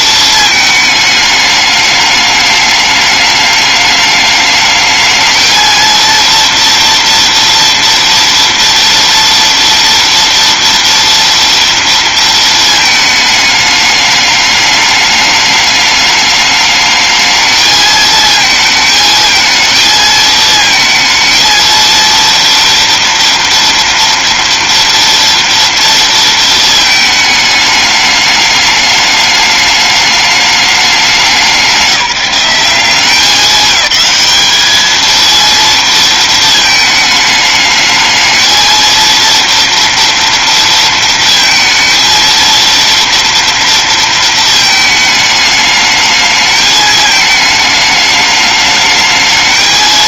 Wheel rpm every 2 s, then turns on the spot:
210, 210, 220, 240, 230, 230, 210, 210, 220, 220, 230, 230, 230, 210, 210, 180, 210, 230, 220, 230, 230, 230, 220, 220, 220.
none